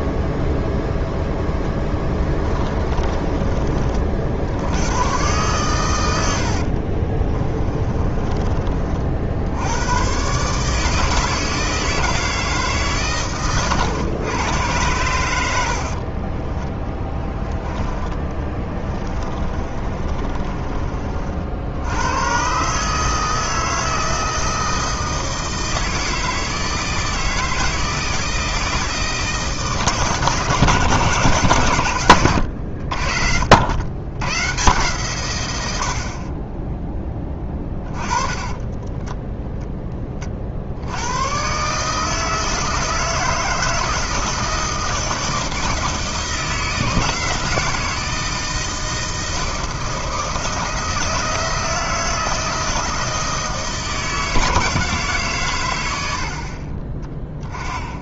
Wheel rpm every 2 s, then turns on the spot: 0, 20, 90, 60, 40, 150, 150, 100, 20, 20, 30, 140, 160, 160, 160, 150, 80, 130, 20, 20, 70, 160, 160, 160, 160, 160, 160, 150, 40.
2-4 6-8 18-22 38-40